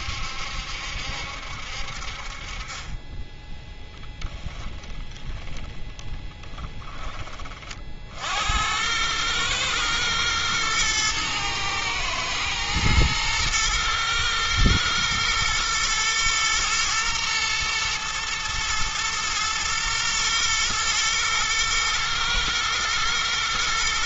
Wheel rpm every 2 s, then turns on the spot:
70, 30, 10, 10, 100, 110, 120, 120, 120, 120, 120, 120.
4-6